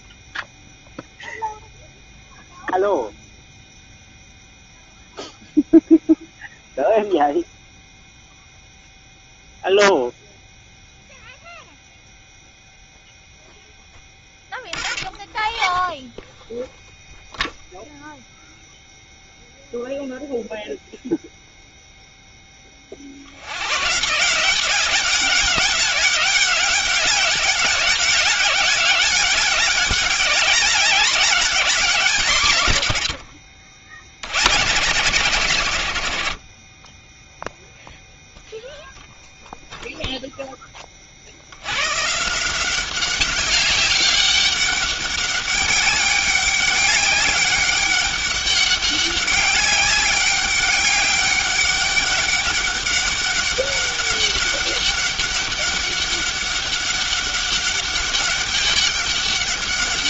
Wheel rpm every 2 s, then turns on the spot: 0, 0, 0, 0, 0, 0, 0, 10, 0, 0, 0, 40, 190, 200, 200, 200, 110, 150, 20, 0, 30, 190, 200, 200, 200, 200, 200, 200, 200, 200.
none